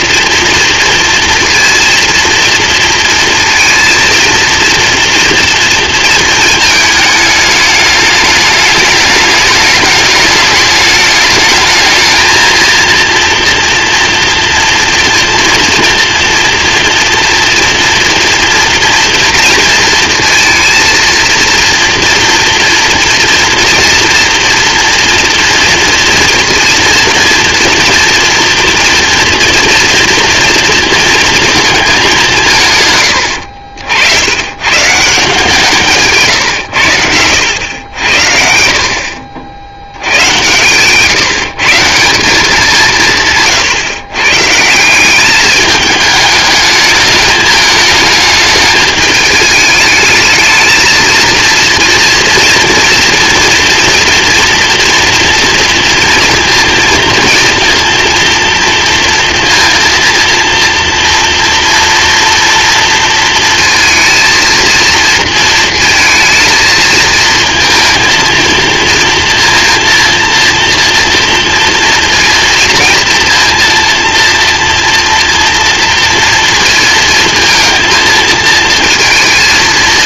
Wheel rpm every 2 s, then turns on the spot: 230, 230, 230, 220, 210, 210, 230, 240, 230, 230, 230, 230, 230, 230, 230, 230, 150, 120, 130, 60, 120, 180, 140, 210, 210, 220, 240, 240, 230, 230, 230, 240, 230, 230, 230, 230, 230, 230, 230, 230.
none